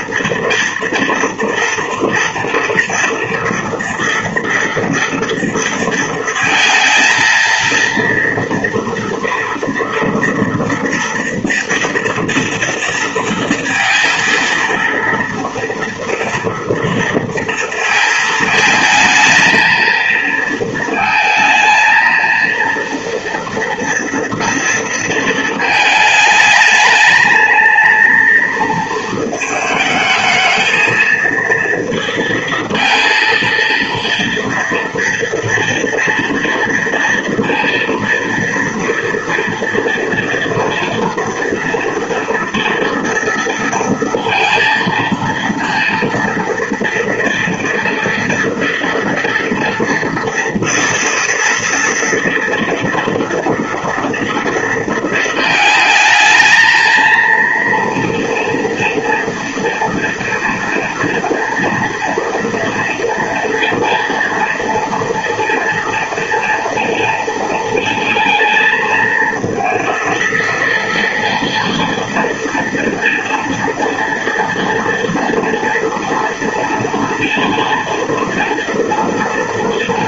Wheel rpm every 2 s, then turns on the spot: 240, 230, 230, 230, 230, 230, 230, 230, 230, 220, 230, 230, 230, 220, 230, 220, 230, 230, 230, 230, 230, 230, 230, 230, 230, 230, 240, 230, 230, 230, 230, 230, 230, 230, 230, 230, 240, 230, 230, 230.
none